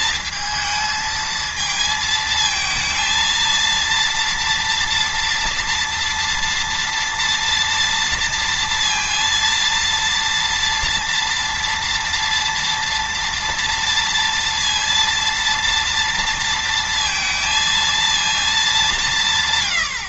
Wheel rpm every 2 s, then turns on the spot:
220, 220, 230, 230, 230, 230, 230, 230, 230, 190.
none